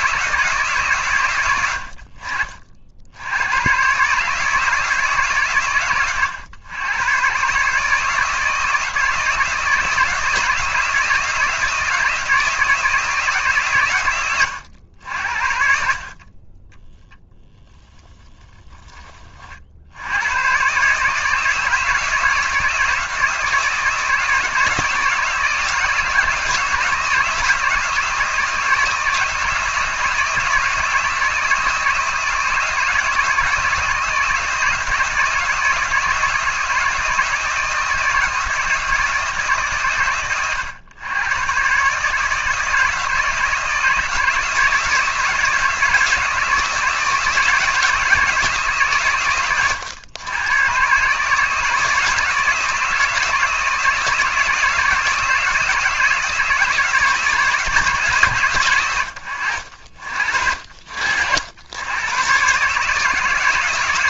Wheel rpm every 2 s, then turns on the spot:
90, 90, 140, 130, 160, 160, 150, 70, 10, 40, 150, 160, 160, 170, 160, 160, 160, 160, 160, 160, 110, 160, 160, 160, 120, 130, 160, 160, 150, 90, 60, 150.
none